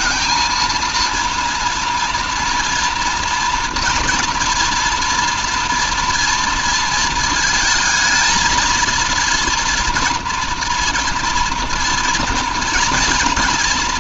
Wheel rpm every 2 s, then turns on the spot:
230, 230, 230, 230, 230, 230, 240.
none